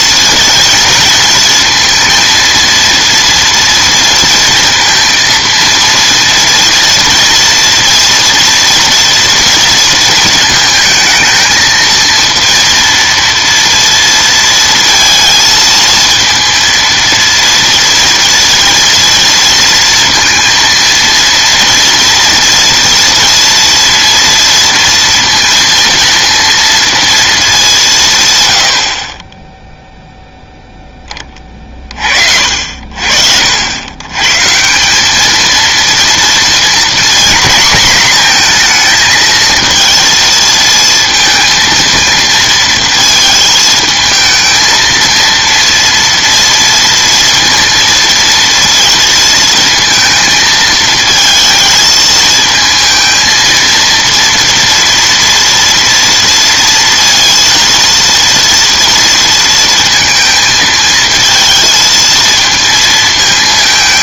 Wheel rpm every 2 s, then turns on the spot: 230, 230, 230, 230, 230, 220, 230, 230, 230, 230, 230, 230, 230, 210, 20, 20, 70, 200, 240, 230, 230, 230, 230, 230, 230, 220, 220, 230, 230, 230, 220, 220.
none